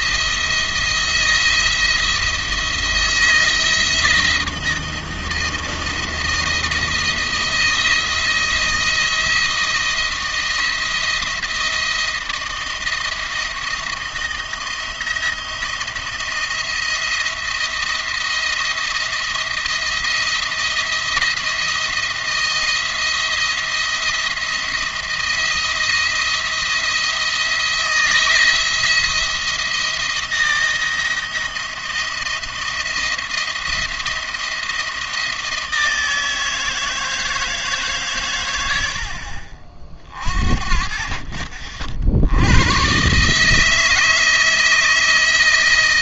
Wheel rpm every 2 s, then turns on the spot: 170, 170, 170, 170, 170, 170, 170, 170, 170, 160, 170, 170, 170, 170, 170, 170, 160, 170, 160, 90, 50, 100, 160.
none